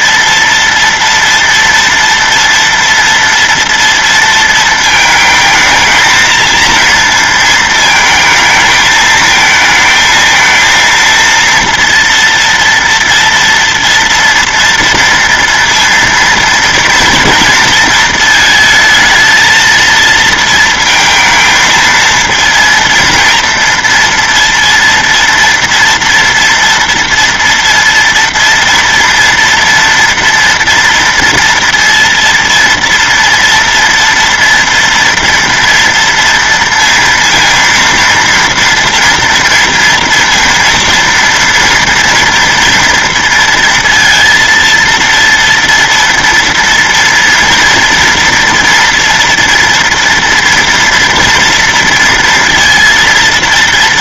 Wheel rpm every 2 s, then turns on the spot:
230, 230, 230, 230, 220, 220, 230, 230, 230, 220, 230, 230, 230, 230, 230, 230, 230, 230, 230, 230, 230, 230, 230, 230, 230, 240, 230.
none